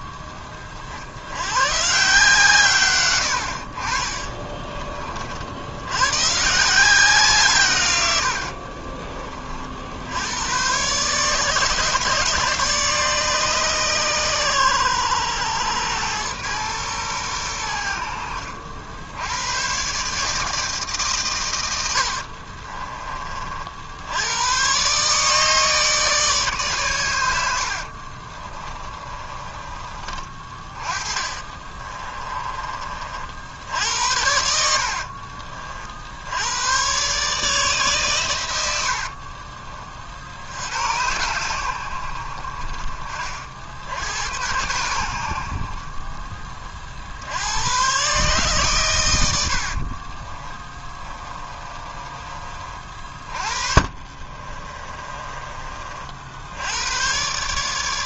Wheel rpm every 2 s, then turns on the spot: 40, 120, 30, 170, 30, 130, 150, 100, 110, 70, 150, 30, 140, 110, 30, 30, 40, 60, 120, 70, 90, 40, 90, 50, 80, 20, 40, 30, 120.
28-32 34-36 38-40 50-52 54-56